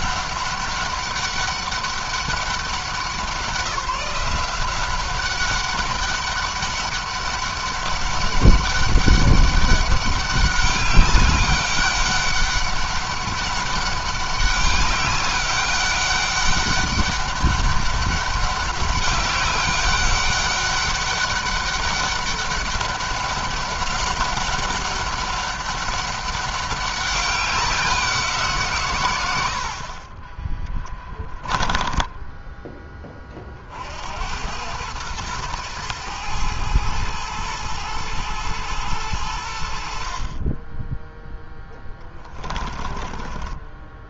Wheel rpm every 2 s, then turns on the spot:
200, 190, 180, 200, 200, 200, 200, 200, 190, 200, 200, 200, 200, 200, 140, 10, 10, 100, 110, 110, 20, 20.
30-32 42-44